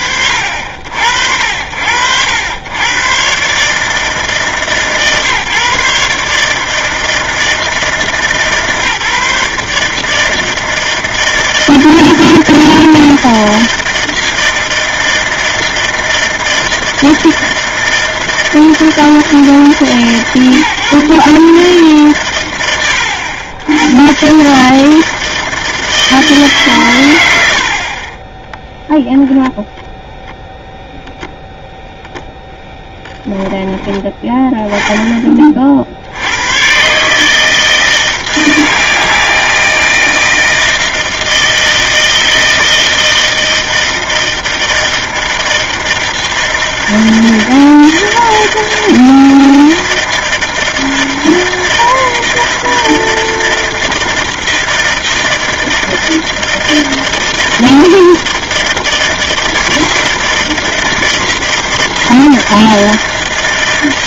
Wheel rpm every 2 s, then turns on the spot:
70, 120, 140, 160, 140, 160, 160, 160, 160, 160, 140, 90, 150, 130, 10, 0, 0, 10, 80, 160, 160, 160, 160, 160, 160, 160, 160, 160, 160, 160, 160, 160.
28-30